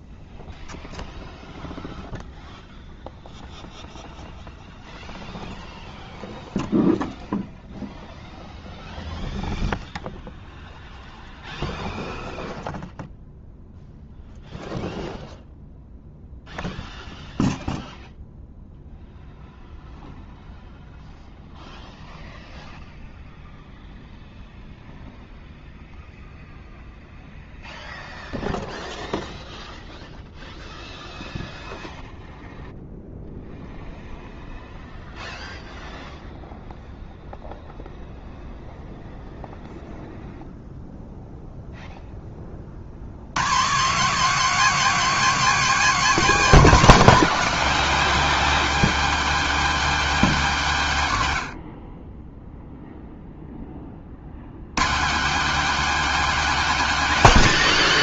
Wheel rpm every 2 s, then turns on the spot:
0, 0, 0, 0, 0, 0, 0, 0, 0, 0, 0, 0, 0, 0, 0, 0, 0, 0, 0, 0, 0, 30, 230, 240, 260, 210, 0, 120, 240.
none